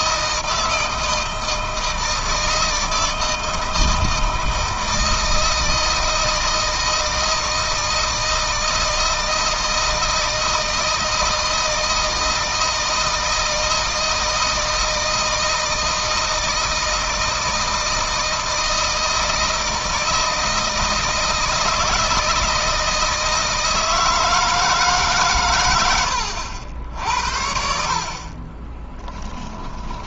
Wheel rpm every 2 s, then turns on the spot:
160, 160, 160, 160, 160, 160, 160, 160, 160, 160, 160, 160, 150, 70, 20.
28-30